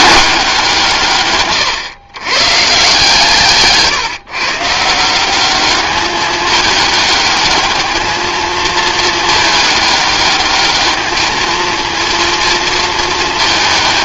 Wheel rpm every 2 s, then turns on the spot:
170, 140, 160, 210, 220, 210, 230.
none